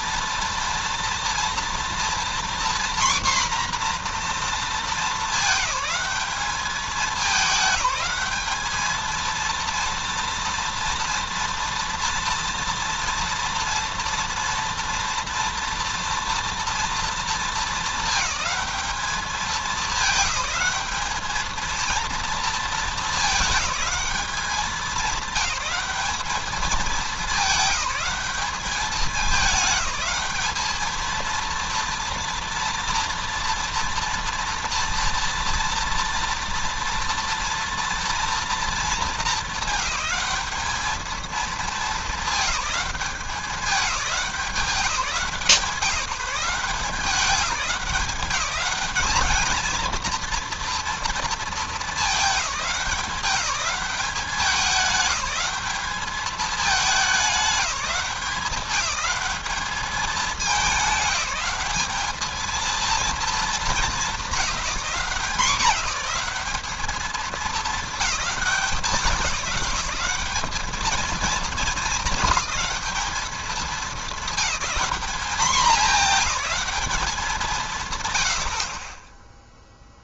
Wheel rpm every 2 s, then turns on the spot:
230, 240, 230, 210, 210, 230, 230, 240, 230, 200, 210, 230, 200, 210, 210, 210, 230, 230, 230, 220, 210, 210, 190, 180, 200, 230, 190, 200, 210, 190, 190, 230, 210, 210, 200, 210, 220, 220, 220, 50.
none